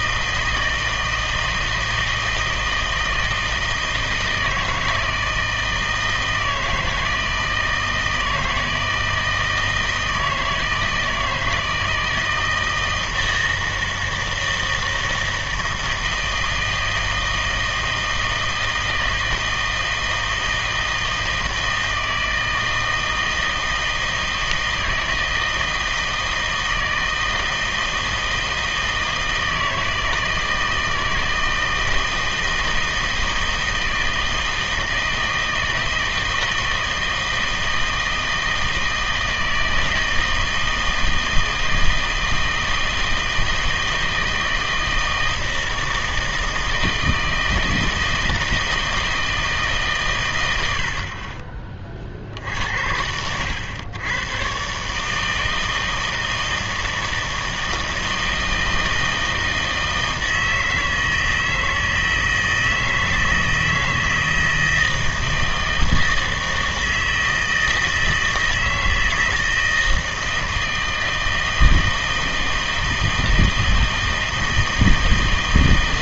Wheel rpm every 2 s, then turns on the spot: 160, 160, 160, 160, 160, 160, 160, 160, 160, 160, 160, 160, 160, 160, 160, 160, 160, 160, 160, 160, 160, 160, 160, 160, 160, 90, 70, 130, 160, 160, 160, 160, 160, 160, 160, 160, 160, 160.
none